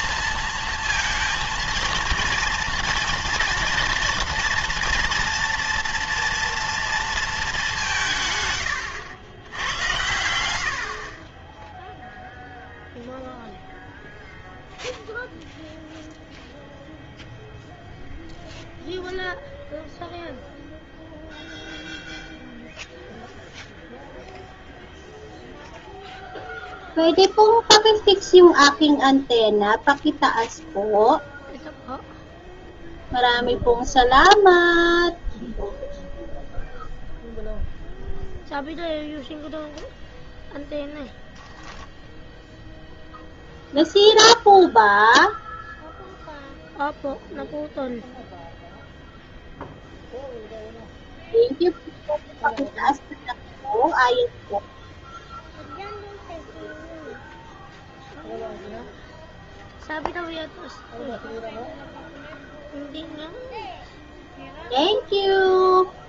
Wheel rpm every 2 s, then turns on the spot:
230, 230, 240, 230, 80, 50, 0, 0, 0, 0, 0, 0, 0, 0, 0, 0, 0, 0, 0, 0, 0, 0, 0, 0, 0, 0, 0, 0, 0, 0, 0, 0, 0.
none